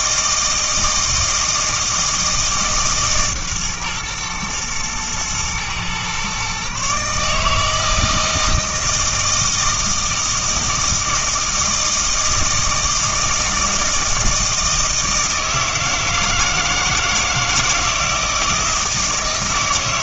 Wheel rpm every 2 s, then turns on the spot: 160, 160, 110, 130, 160, 160, 160, 160, 160, 160.
none